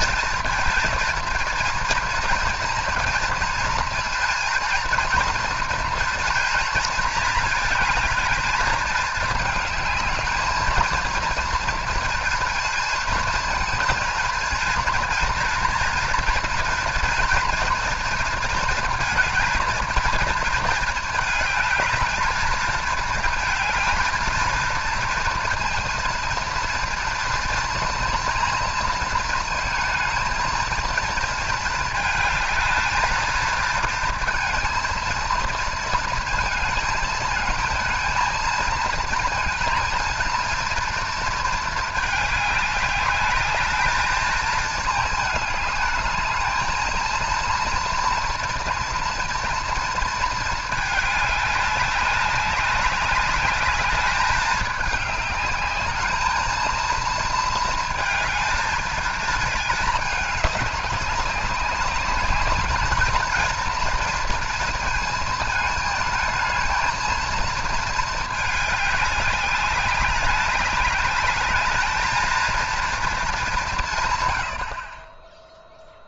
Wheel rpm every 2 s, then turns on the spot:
230, 230, 230, 240, 220, 220, 230, 240, 240, 230, 230, 220, 230, 230, 230, 230, 210, 230, 220, 230, 230, 210, 220, 210, 230, 220, 190, 210, 220, 220, 200, 210, 230, 220, 210, 200, 230, 60.
none